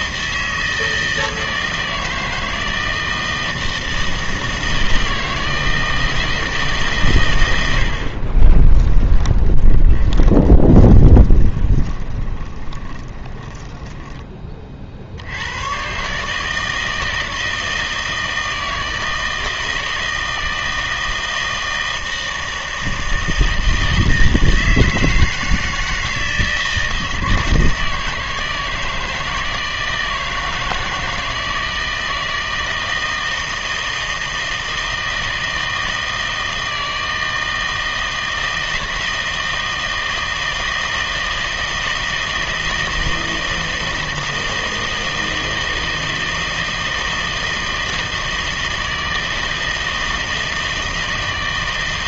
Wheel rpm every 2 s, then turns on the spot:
160, 160, 160, 120, 10, 10, 20, 60, 160, 160, 160, 160, 160, 160, 160, 160, 160, 160, 160, 160, 160, 160, 160, 160, 160, 160.
8-14